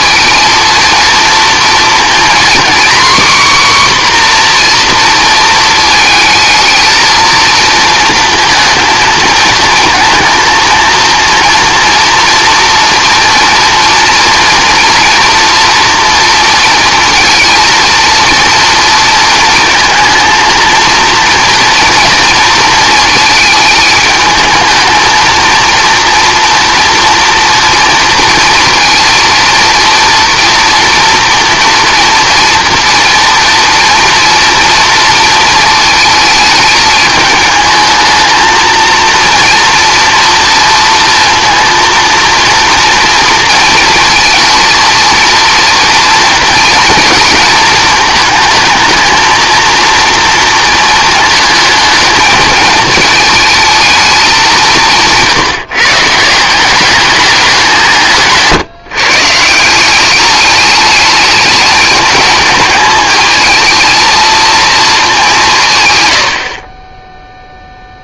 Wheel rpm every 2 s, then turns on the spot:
230, 260, 250, 220, 230, 230, 240, 230, 230, 230, 230, 230, 220, 230, 230, 230, 240, 230, 210, 220, 230, 230, 230, 220, 220, 230, 220, 190, 180, 150, 210, 220, 220, 30.
66-68